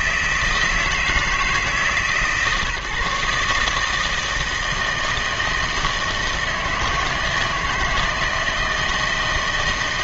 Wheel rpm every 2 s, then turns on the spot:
160, 150, 160, 160, 160.
none